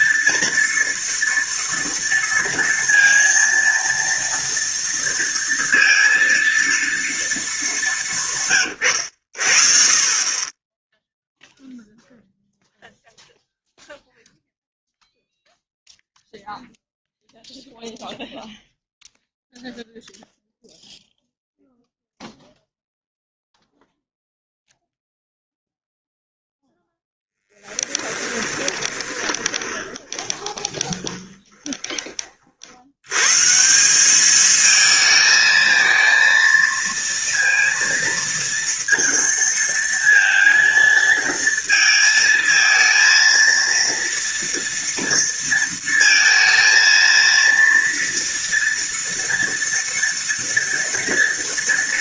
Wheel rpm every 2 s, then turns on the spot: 230, 230, 230, 230, 110, 10, 0, 0, 0, 0, 0, 0, 0, 0, 20, 20, 90, 220, 230, 230, 230, 220, 230, 230, 230, 230.
28-32